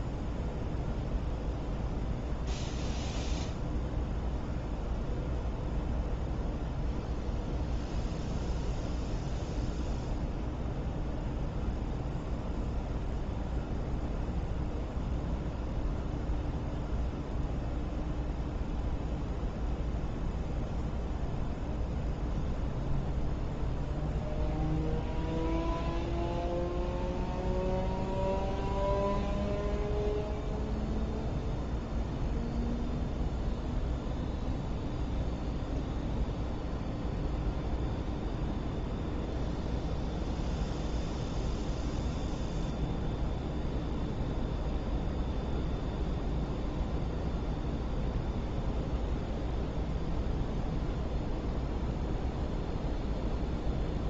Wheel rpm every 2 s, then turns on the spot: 0, 0, 0, 0, 0, 0, 0, 0, 0, 0, 0, 0, 0, 0, 0, 0, 0, 0, 0, 0, 0, 0, 0, 0, 0, 0, 0.
none